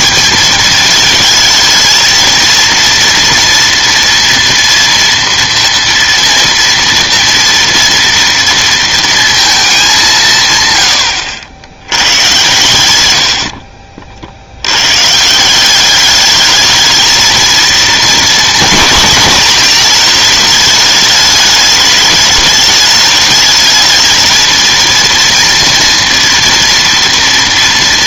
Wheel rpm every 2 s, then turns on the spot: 210, 230, 230, 230, 230, 120, 100, 100, 220, 240, 210, 210, 230, 230.
12-14